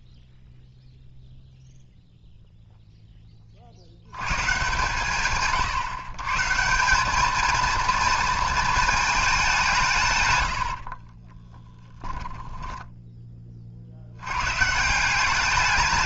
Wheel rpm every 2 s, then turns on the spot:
0, 0, 140, 160, 230, 70, 10, 140.
10-14